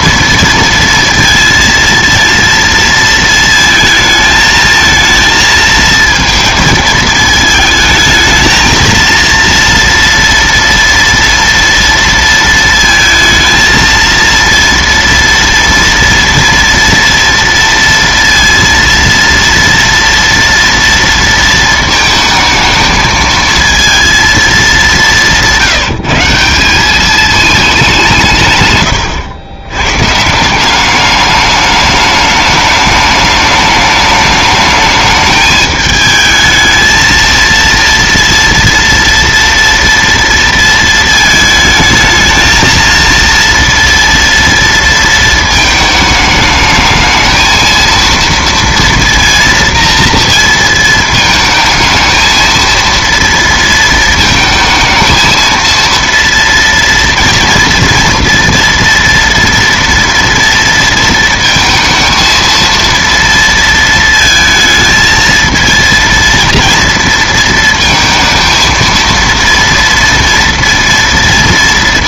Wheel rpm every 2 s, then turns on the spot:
230, 230, 220, 220, 220, 230, 220, 230, 230, 230, 230, 220, 210, 180, 120, 180, 210, 210, 220, 230, 230, 220, 230, 220, 230, 230, 230, 230, 230, 230, 230, 230, 220, 230, 230, 230.
none